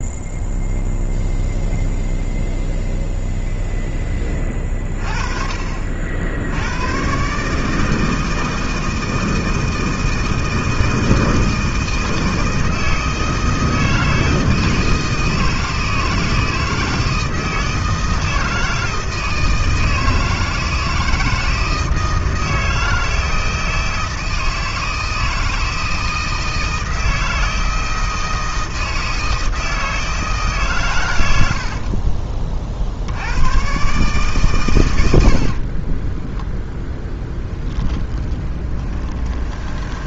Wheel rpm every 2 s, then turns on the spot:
0, 0, 30, 110, 160, 160, 160, 160, 160, 160, 160, 160, 160, 160, 160, 120, 60, 100, 10, 20.
36-40